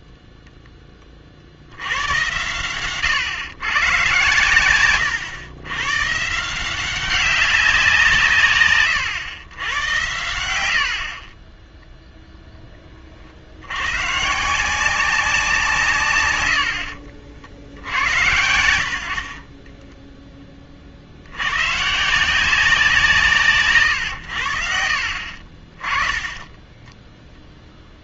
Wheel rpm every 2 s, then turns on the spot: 0, 110, 110, 170, 130, 60, 10, 160, 100, 80, 30, 180, 60, 10.
4-6 10-12 24-28